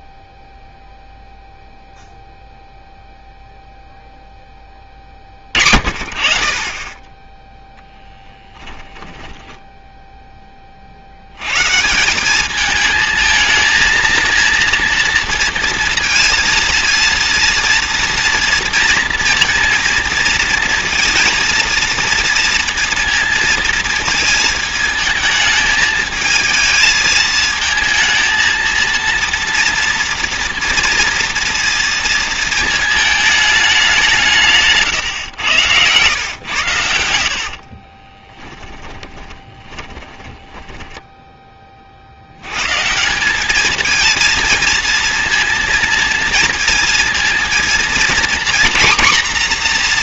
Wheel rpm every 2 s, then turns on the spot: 0, 0, 20, 30, 10, 30, 220, 230, 230, 230, 230, 230, 220, 220, 230, 230, 220, 140, 100, 20, 10, 150, 230, 230, 250.
8-10 34-36 38-42